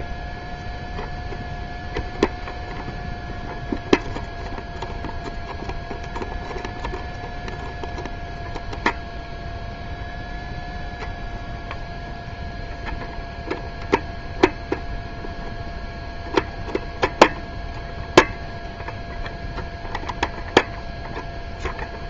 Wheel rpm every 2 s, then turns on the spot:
0, 0, 0, 0, 0, 0, 0, 0, 0, 0, 0.
none